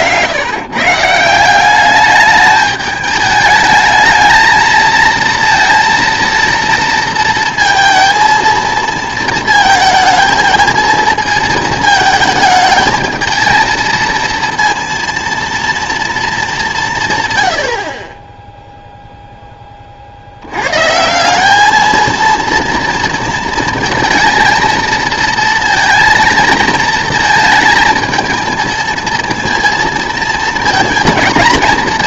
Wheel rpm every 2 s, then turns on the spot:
140, 210, 220, 230, 230, 220, 220, 230, 190, 0, 110, 230, 230, 230, 230, 230.
none